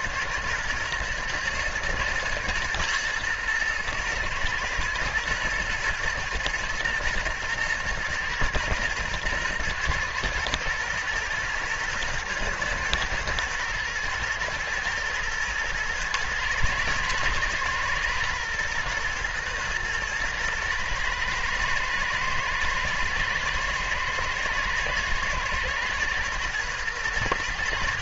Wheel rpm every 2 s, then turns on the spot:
120, 120, 110, 110, 120, 110, 110, 110, 120, 120, 110, 110, 110, 120.
none